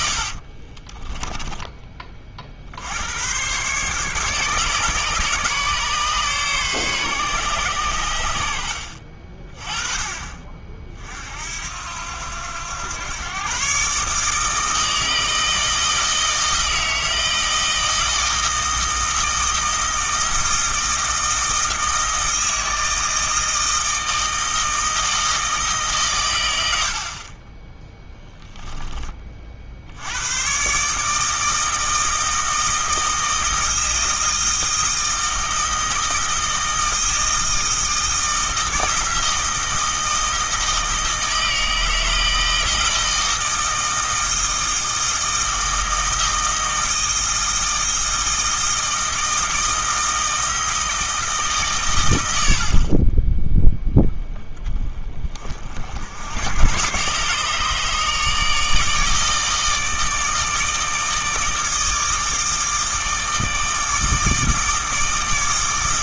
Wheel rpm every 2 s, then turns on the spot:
30, 70, 140, 130, 70, 50, 100, 160, 160, 160, 160, 160, 160, 80, 10, 140, 160, 160, 160, 160, 160, 160, 160, 160, 160, 160, 60, 20, 120, 160, 160, 160, 160.
0-2